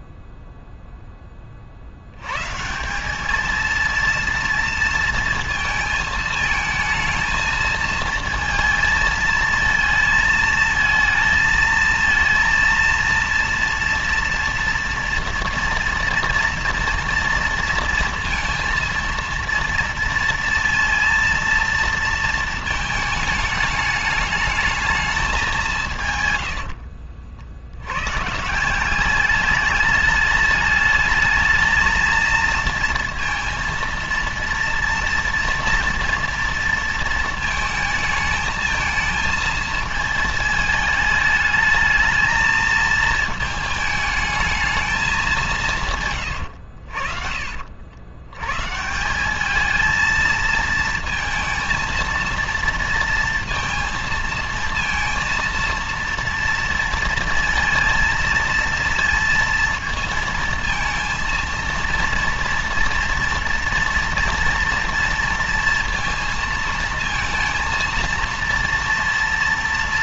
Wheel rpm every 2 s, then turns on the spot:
0, 170, 230, 220, 230, 220, 230, 230, 230, 230, 220, 220, 210, 90, 170, 210, 230, 230, 230, 220, 220, 220, 220, 80, 140, 230, 230, 230, 230, 230, 230, 230, 230, 230, 240.
26-28